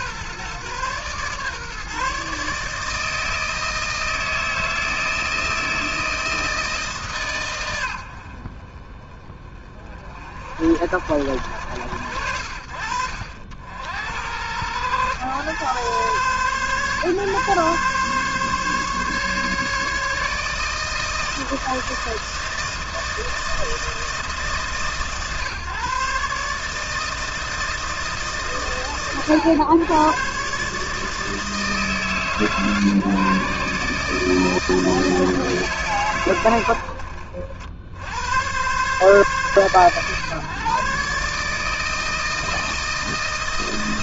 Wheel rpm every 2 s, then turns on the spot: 120, 150, 160, 160, 70, 50, 60, 100, 120, 140, 150, 160, 160, 140, 150, 100, 140, 160, 120, 100, 120, 160.
none